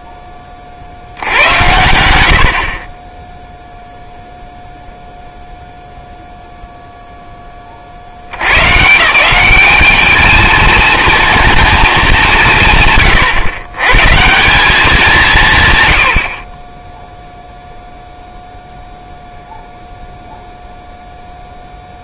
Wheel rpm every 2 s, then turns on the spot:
30, 50, 0, 0, 130, 220, 190, 160, 30, 0, 0.
none